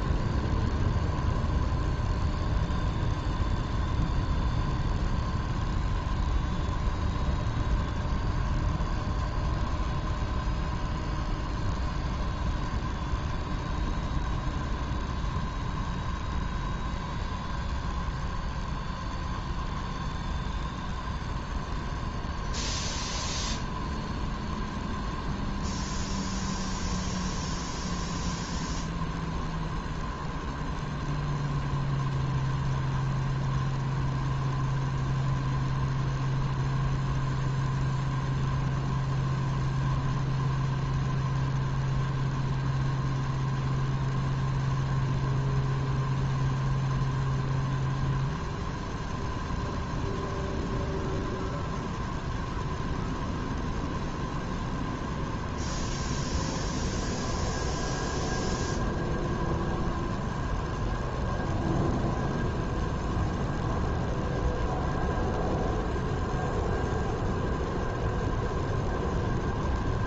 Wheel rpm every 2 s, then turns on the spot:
0, 0, 0, 0, 0, 0, 0, 0, 0, 0, 0, 0, 0, 0, 0, 0, 0, 0, 0, 0, 0, 0, 0, 0, 0, 0, 0, 0, 0, 0, 0, 0, 0, 0, 0.
none